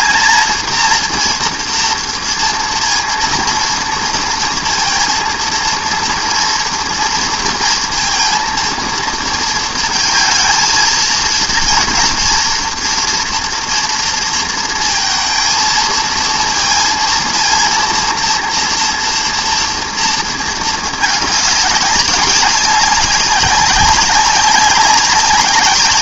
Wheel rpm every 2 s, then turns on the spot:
230, 230, 230, 230, 230, 220, 230, 230, 230, 230, 220, 190, 190.
none